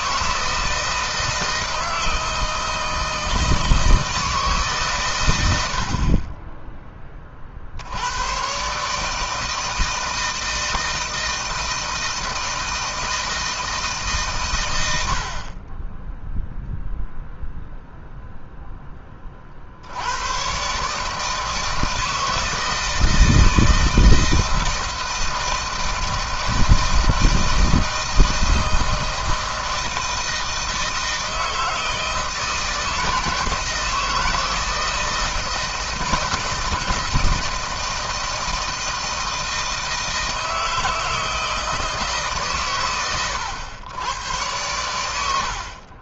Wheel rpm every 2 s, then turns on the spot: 160, 160, 150, 30, 130, 160, 160, 120, 0, 0, 120, 160, 160, 160, 160, 160, 160, 160, 160, 160, 160, 140, 100.
none